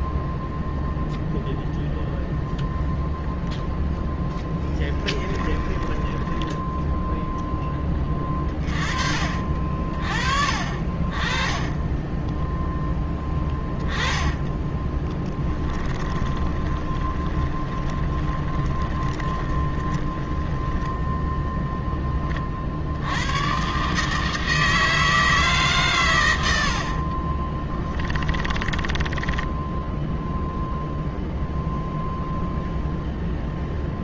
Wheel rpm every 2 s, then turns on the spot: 0, 0, 10, 10, 40, 50, 20, 20, 20, 20, 10, 60, 160, 70, 10, 0, 0.
4-8 14-22 28-30